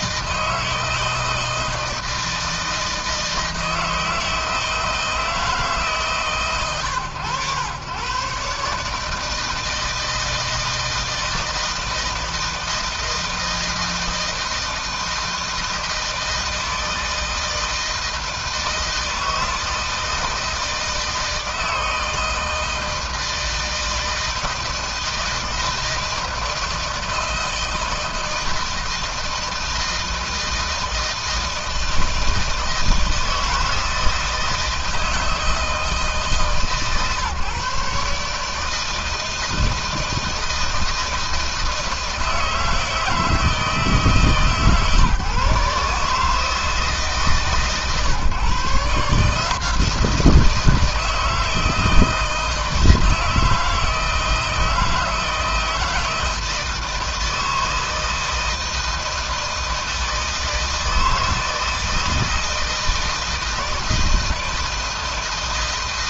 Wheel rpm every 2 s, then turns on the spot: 160, 160, 160, 120, 150, 160, 160, 160, 160, 160, 160, 160, 160, 160, 160, 160, 160, 160, 140, 160, 160, 160, 150, 150, 150, 170, 160, 160, 160, 160, 160, 160, 160.
none